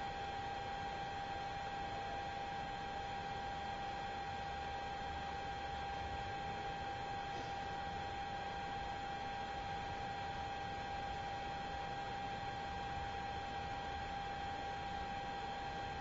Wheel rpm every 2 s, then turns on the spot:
0, 0, 0, 0, 0, 0, 0, 0.
none